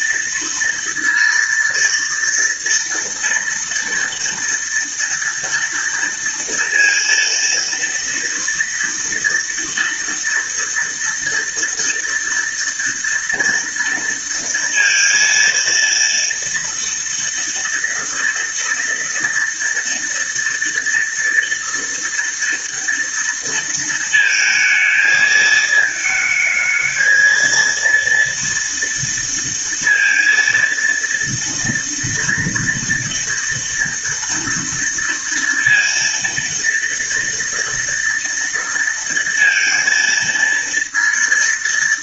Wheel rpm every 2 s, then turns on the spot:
230, 230, 230, 230, 230, 230, 230, 230, 230, 230, 230, 230, 220, 220, 230, 230, 230, 230, 230, 230, 230.
none